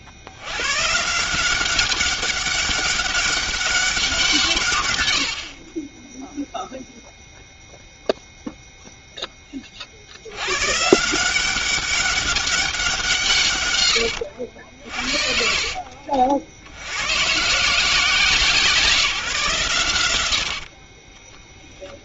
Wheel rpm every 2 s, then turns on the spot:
140, 190, 110, 0, 0, 140, 180, 60, 90, 170, 30.
20-22